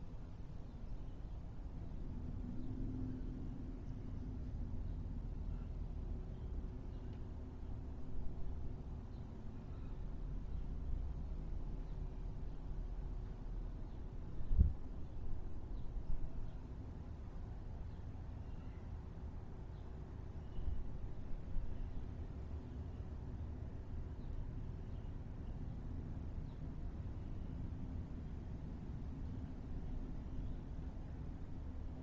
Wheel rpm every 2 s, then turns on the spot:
0, 0, 0, 0, 0, 0, 0, 0, 0, 0, 0, 0, 0, 0, 0, 0.
none